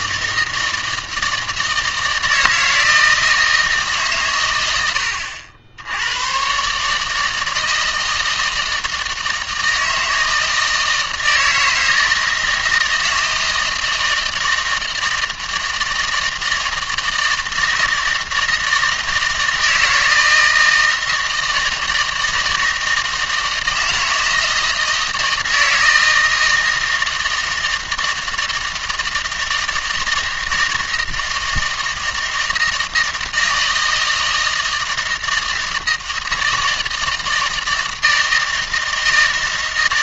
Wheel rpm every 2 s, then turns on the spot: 160, 160, 90, 140, 160, 160, 160, 160, 160, 160, 160, 160, 160, 160, 160, 160, 160, 160, 160, 160.
none